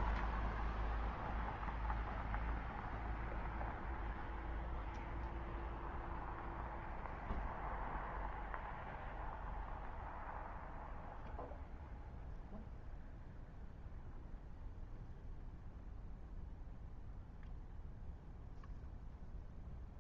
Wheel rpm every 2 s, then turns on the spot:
10, 0, 0, 0, 0, 0, 0, 0, 0, 0.
none